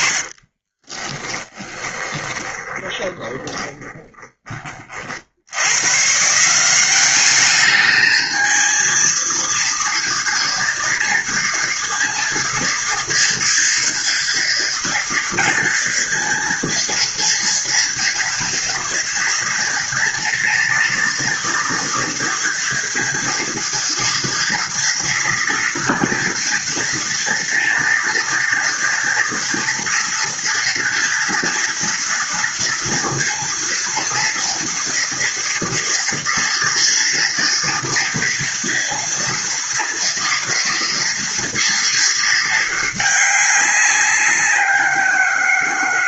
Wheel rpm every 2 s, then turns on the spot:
20, 20, 50, 200, 230, 230, 230, 230, 230, 230, 230, 230, 230, 230, 230, 230, 230, 230, 230, 230, 230, 210, 180.
0-4